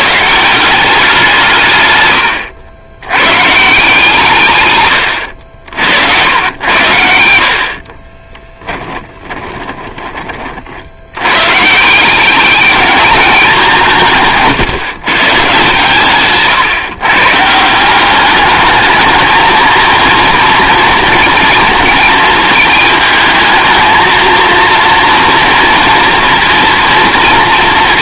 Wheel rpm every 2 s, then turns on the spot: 180, 90, 70, 100, 10, 60, 210, 150, 140, 220, 230, 220, 230, 230.
6-10